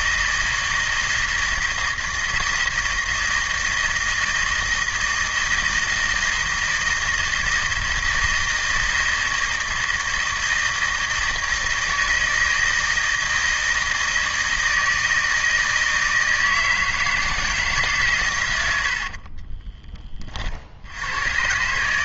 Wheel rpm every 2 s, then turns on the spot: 160, 160, 160, 160, 160, 160, 160, 160, 160, 70, 80.
none